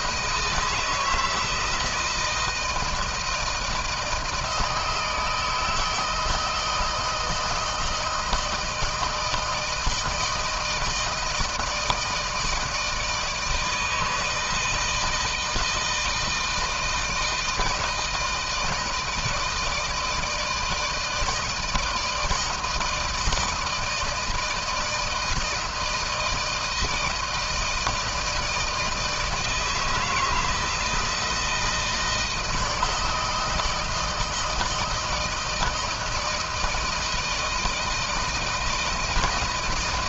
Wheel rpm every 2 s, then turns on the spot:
160, 160, 160, 160, 160, 160, 160, 160, 160, 160, 160, 160, 160, 160, 160, 160, 160, 170, 170, 160.
none